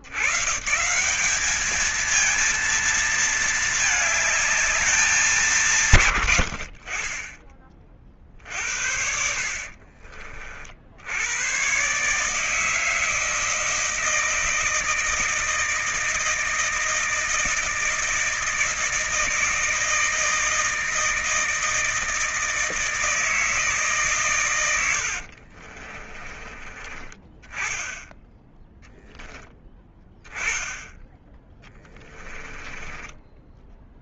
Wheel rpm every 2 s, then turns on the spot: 70, 220, 220, 150, 40, 50, 130, 160, 160, 160, 160, 160, 140, 40, 10, 10, 10.
10-12 26-28 32-34